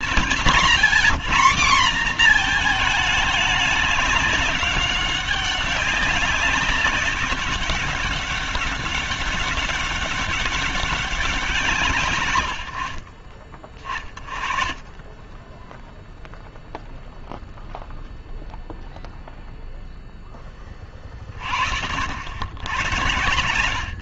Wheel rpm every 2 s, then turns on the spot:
160, 230, 200, 190, 200, 200, 120, 30, 0, 0, 20, 80.
none